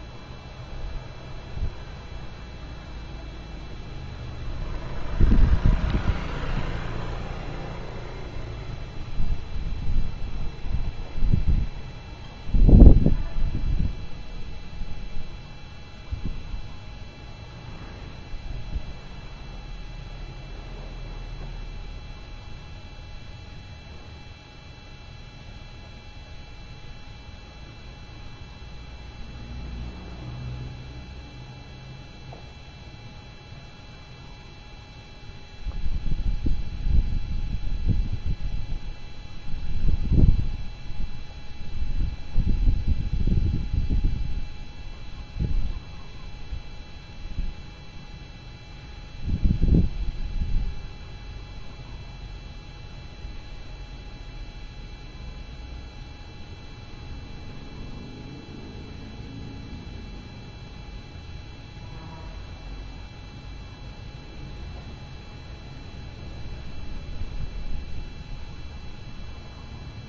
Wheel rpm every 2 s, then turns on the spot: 0, 0, 0, 0, 0, 0, 0, 0, 0, 0, 0, 0, 0, 0, 0, 0, 0, 0, 0, 0, 0, 0, 0, 0, 0, 0, 0, 0, 0, 0, 0, 0, 0, 0, 0.
none